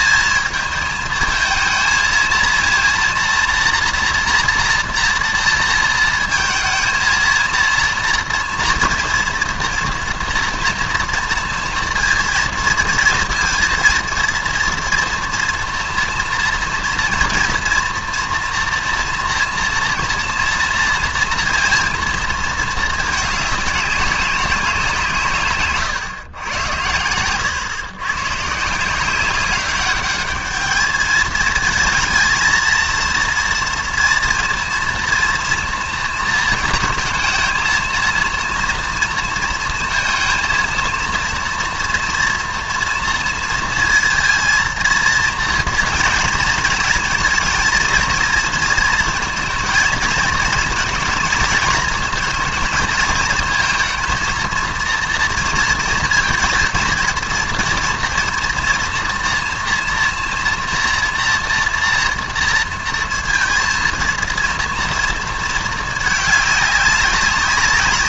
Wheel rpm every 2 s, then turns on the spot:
220, 230, 240, 220, 230, 230, 230, 230, 230, 230, 230, 230, 190, 100, 150, 210, 230, 230, 220, 230, 230, 230, 230, 230, 230, 220, 220, 230, 230, 230, 230, 230, 230, 210.
none